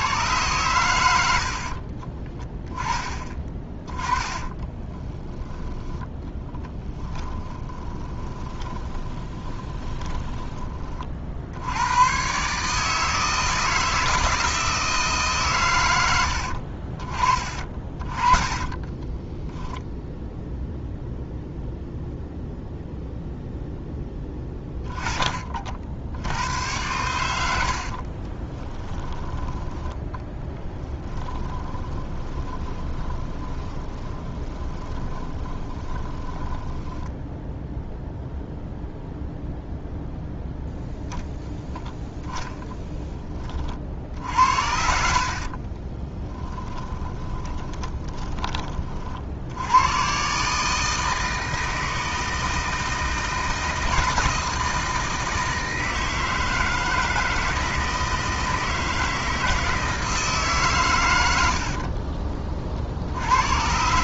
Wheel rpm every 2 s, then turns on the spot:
100, 10, 20, 20, 20, 30, 150, 160, 60, 20, 0, 0, 20, 90, 10, 10, 20, 20, 10, 0, 0, 10, 70, 20, 30, 150, 160, 160, 160, 160, 140, 40.
4-10 18-20 28-38 44-48